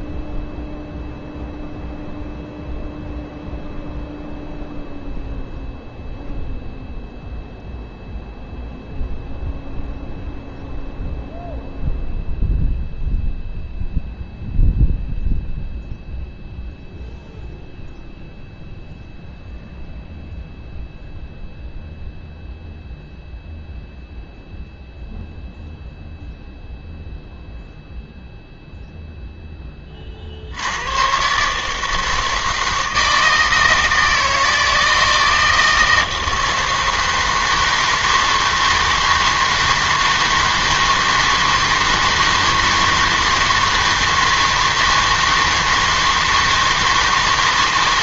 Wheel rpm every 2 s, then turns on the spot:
0, 0, 0, 0, 0, 0, 0, 0, 0, 0, 0, 0, 0, 0, 0, 80, 160, 160, 160, 160, 160, 160, 160, 160.
none